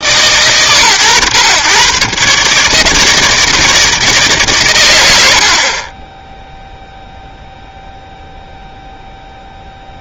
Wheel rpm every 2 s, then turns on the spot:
110, 150, 120, 0, 0.
none